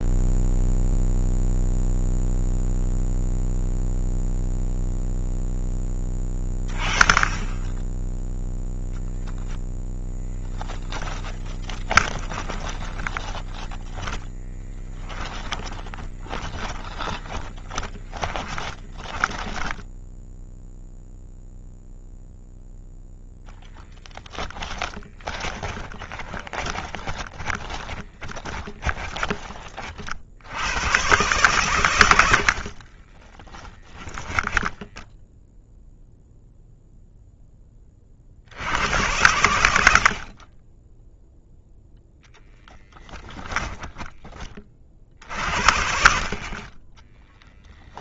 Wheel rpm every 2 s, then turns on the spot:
0, 0, 0, 20, 0, 10, 20, 10, 30, 10, 0, 0, 20, 20, 20, 110, 30, 10, 0, 90, 10, 10, 40, 10.
10-20 24-28 32-36 42-44 46-48